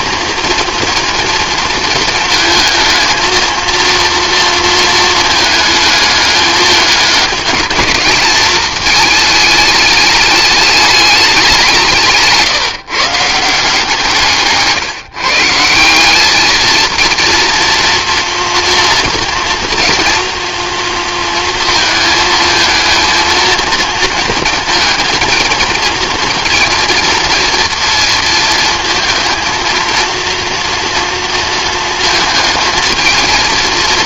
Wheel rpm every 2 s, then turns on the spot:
230, 220, 230, 210, 220, 210, 160, 140, 220, 230, 230, 220, 230, 230, 230, 230, 220.
none